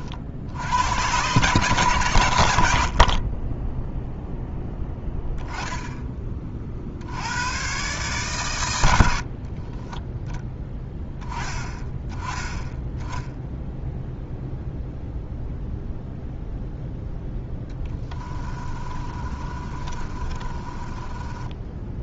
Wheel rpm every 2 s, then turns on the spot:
110, 50, 10, 60, 90, 10, 10, 0, 0, 30, 20.
18-22